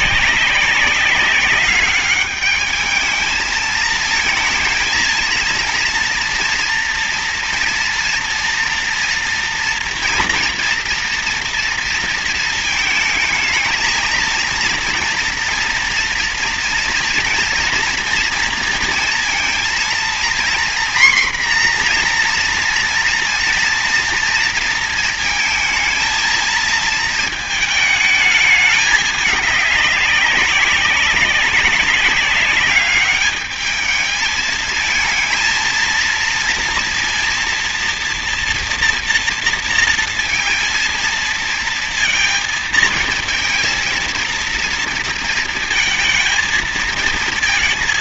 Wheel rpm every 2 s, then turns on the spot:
190, 210, 230, 230, 230, 230, 230, 230, 230, 230, 240, 240, 230, 220, 210, 200, 200, 220, 230, 230, 230, 220, 230, 220.
none